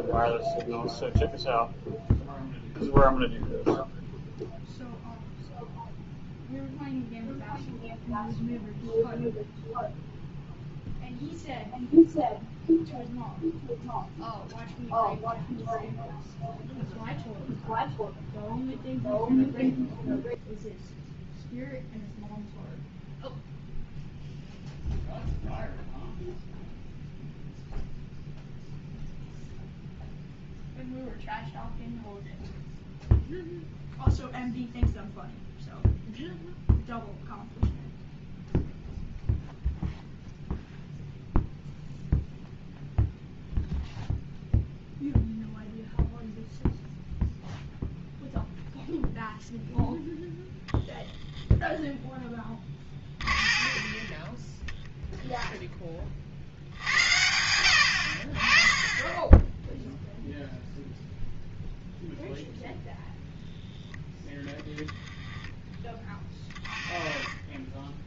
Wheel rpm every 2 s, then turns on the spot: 0, 0, 0, 0, 0, 0, 0, 0, 0, 0, 0, 0, 0, 0, 0, 0, 0, 0, 0, 0, 0, 0, 0, 0, 0, 0, 30, 10, 70, 20, 0, 0, 10, 20.
52-54